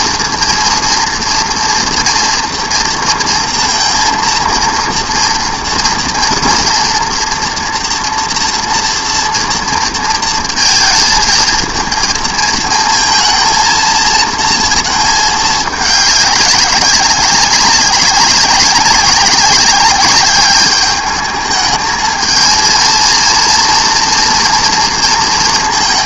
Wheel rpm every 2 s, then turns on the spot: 230, 230, 230, 240, 230, 220, 220, 220, 190, 190, 210, 230, 230.
none